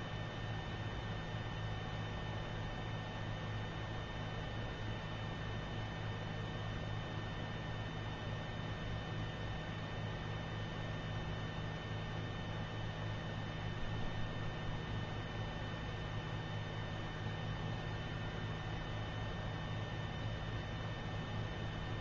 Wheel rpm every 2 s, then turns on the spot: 0, 0, 0, 0, 0, 0, 0, 0, 0, 0, 0.
none